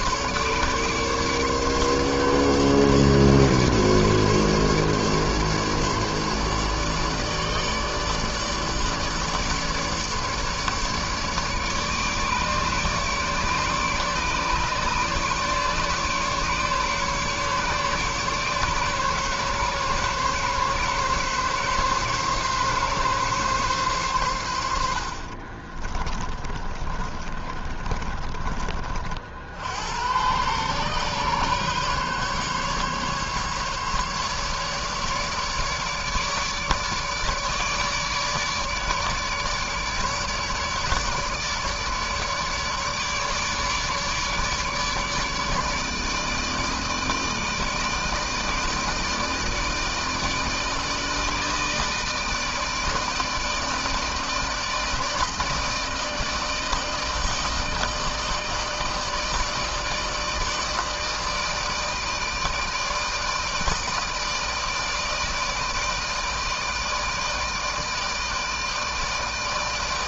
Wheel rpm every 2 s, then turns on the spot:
150, 140, 150, 150, 150, 150, 150, 140, 150, 140, 140, 140, 100, 30, 30, 110, 140, 150, 150, 150, 150, 150, 150, 160, 150, 160, 160, 160, 160, 160, 160, 160, 160, 160, 160.
26-28